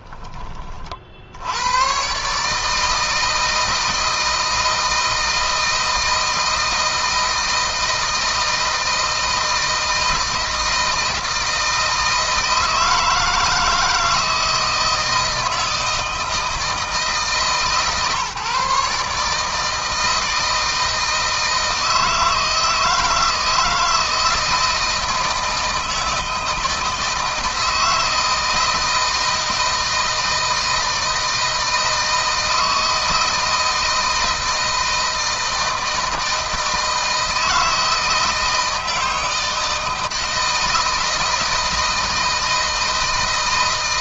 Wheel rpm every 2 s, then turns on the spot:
40, 160, 160, 160, 160, 160, 160, 160, 150, 150, 160, 160, 160, 160, 160, 160, 160, 160, 160, 160, 160, 160.
none